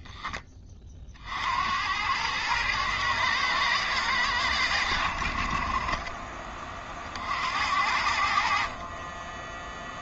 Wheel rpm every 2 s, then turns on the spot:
40, 110, 80, 40, 40.
none